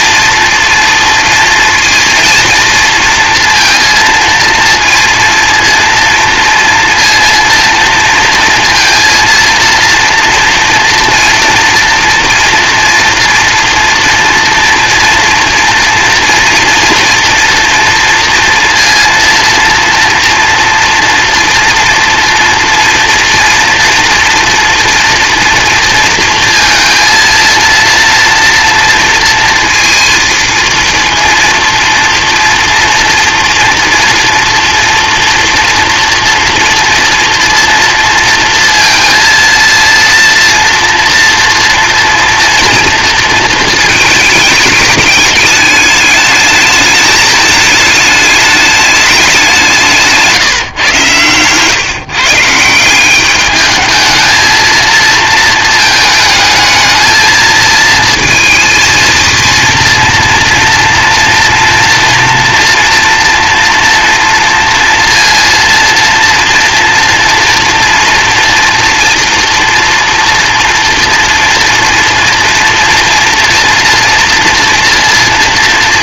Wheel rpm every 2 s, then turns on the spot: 230, 230, 230, 230, 230, 230, 230, 230, 230, 230, 230, 240, 230, 230, 230, 230, 230, 230, 230, 230, 230, 230, 210, 220, 210, 140, 170, 230, 220, 230, 230, 230, 230, 230, 230, 230, 240, 230.
none